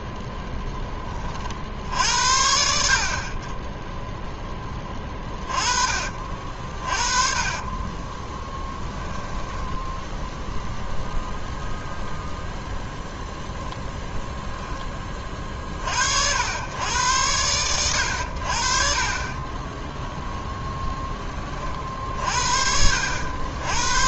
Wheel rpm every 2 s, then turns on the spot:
10, 40, 20, 40, 10, 0, 0, 20, 100, 60, 20, 70.
4-10 18-20